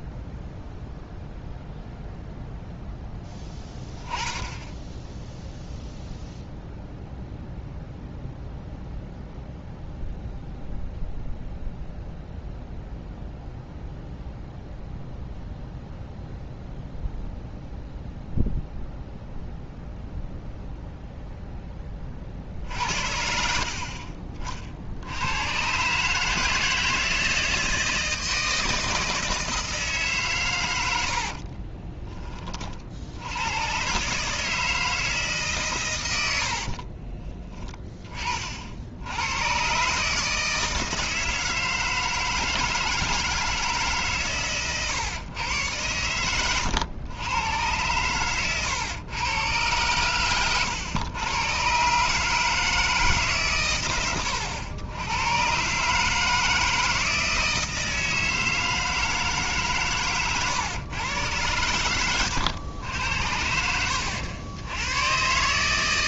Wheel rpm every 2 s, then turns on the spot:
0, 0, 10, 0, 0, 0, 0, 0, 0, 0, 0, 60, 50, 160, 160, 100, 50, 160, 50, 70, 160, 160, 140, 110, 120, 110, 160, 100, 160, 160, 120, 90, 100.
36-38